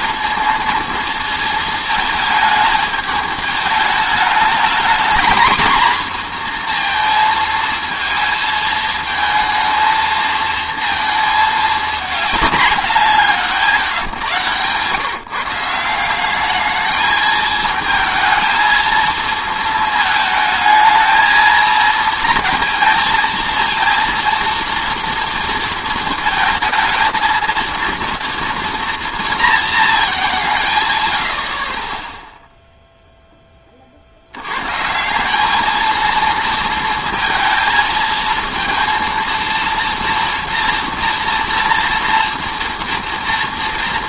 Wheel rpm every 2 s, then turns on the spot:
230, 220, 220, 240, 220, 230, 210, 130, 210, 220, 220, 230, 240, 220, 230, 150, 0, 110, 230, 230, 230, 230.
none